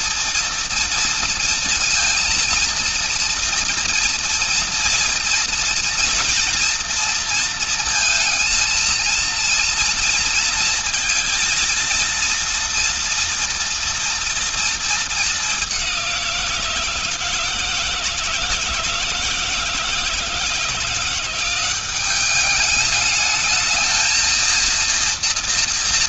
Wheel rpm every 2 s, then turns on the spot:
230, 230, 230, 230, 230, 230, 230, 220, 160, 160, 170, 210, 230.
none